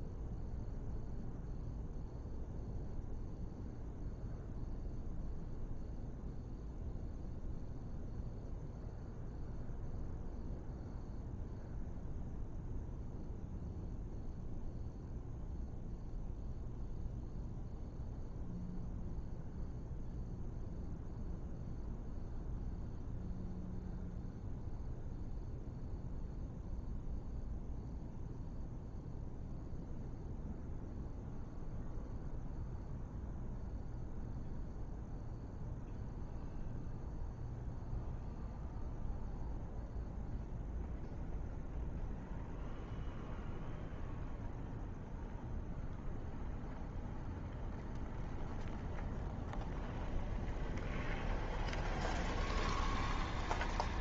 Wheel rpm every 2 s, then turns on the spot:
0, 0, 0, 0, 0, 0, 0, 0, 0, 0, 0, 0, 0, 0, 0, 0, 0, 0, 0, 0, 0, 0, 0, 0, 0, 0, 0.
none